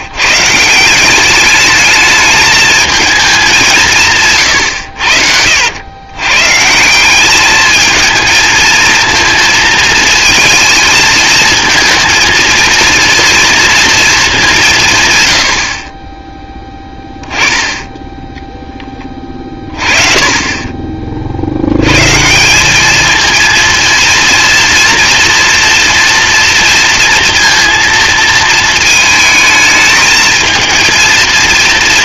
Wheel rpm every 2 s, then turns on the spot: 170, 220, 90, 170, 220, 220, 230, 150, 10, 20, 30, 200, 230, 230, 220, 220.
none